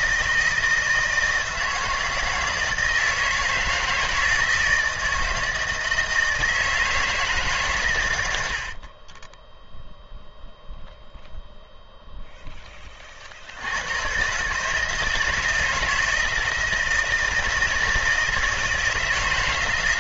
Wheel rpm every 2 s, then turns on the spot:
160, 160, 160, 160, 40, 0, 30, 160, 160, 160.
8-10